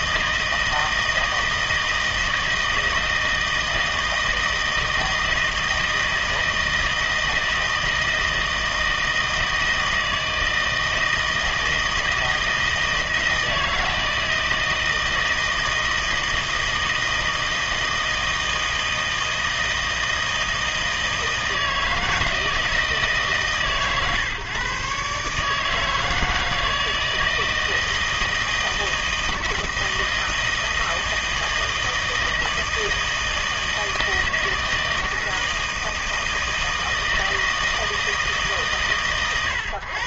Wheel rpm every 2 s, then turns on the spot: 160, 160, 160, 160, 160, 160, 160, 160, 160, 160, 160, 160, 140, 160, 160, 160, 160, 160, 160, 140.
none